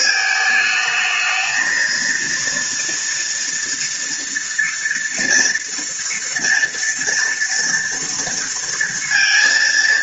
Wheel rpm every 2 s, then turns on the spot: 220, 230, 230, 230, 230.
none